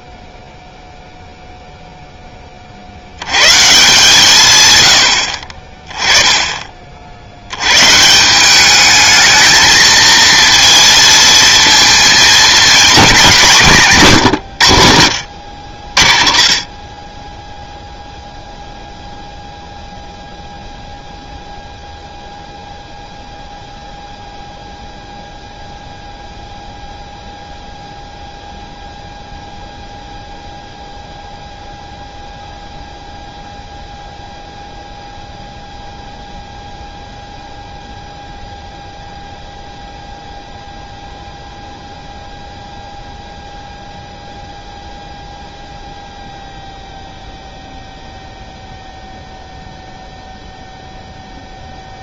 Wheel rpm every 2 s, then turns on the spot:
0, 60, 100, 50, 210, 230, 210, 70, 20, 0, 0, 0, 0, 0, 0, 0, 0, 0, 0, 0, 0, 0, 0, 0, 0, 0.
none